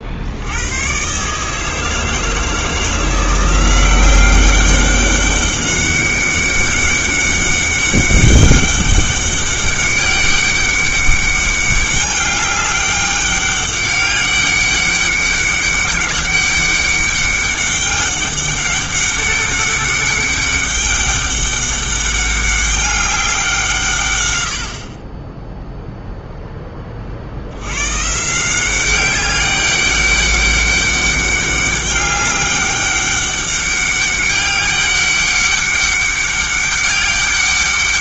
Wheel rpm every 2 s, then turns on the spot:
120, 160, 200, 200, 200, 200, 200, 200, 200, 200, 200, 200, 40, 30, 190, 200, 200, 200, 200.
none